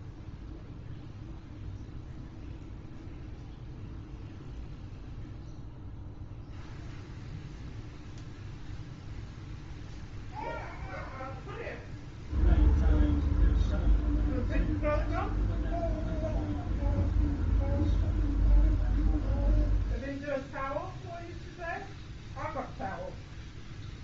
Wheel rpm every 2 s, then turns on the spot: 0, 0, 0, 0, 0, 0, 0, 0, 0, 0, 0, 0.
none